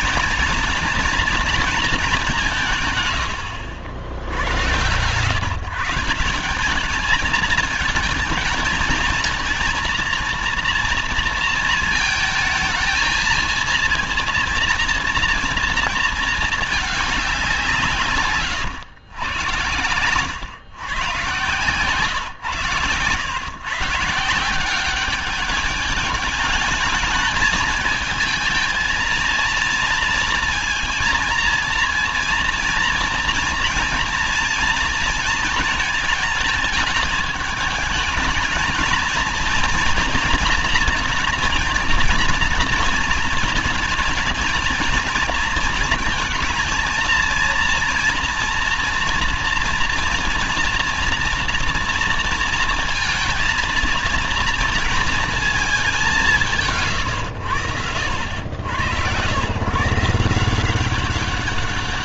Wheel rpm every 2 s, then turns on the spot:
230, 170, 80, 190, 220, 230, 220, 230, 220, 130, 120, 130, 180, 210, 220, 230, 230, 230, 220, 220, 230, 230, 230, 220, 230, 230, 230, 230, 180, 90, 180.
none